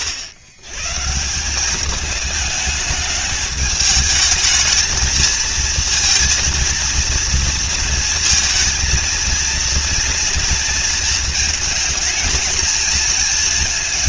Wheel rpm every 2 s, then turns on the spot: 110, 210, 220, 230, 220, 230, 230.
none